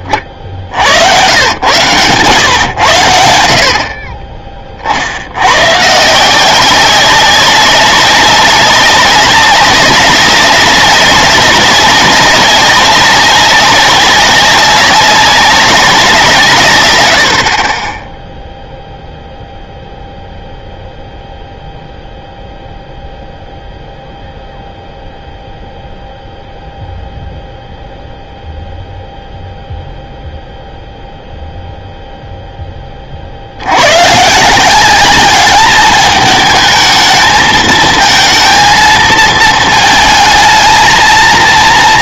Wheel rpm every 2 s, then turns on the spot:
70, 110, 30, 190, 200, 200, 190, 200, 140, 0, 0, 0, 0, 0, 0, 0, 10, 170, 220, 230, 220.
none